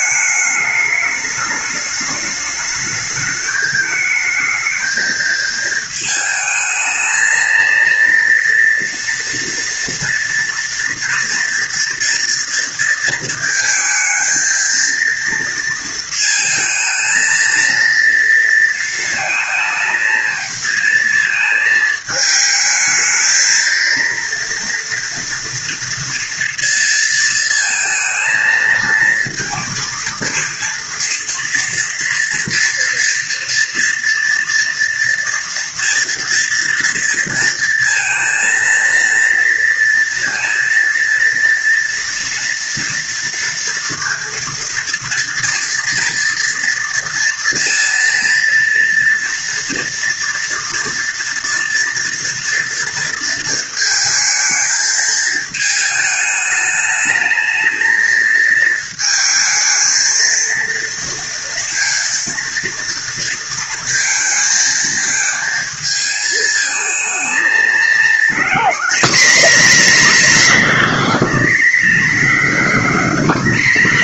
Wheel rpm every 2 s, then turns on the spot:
210, 210, 220, 220, 230, 240, 230, 230, 230, 230, 220, 220, 230, 230, 230, 230, 230, 230, 230, 230, 230, 230, 230, 230, 230, 230, 230, 220, 210, 220, 230, 230, 220, 220, 230, 270, 270.
none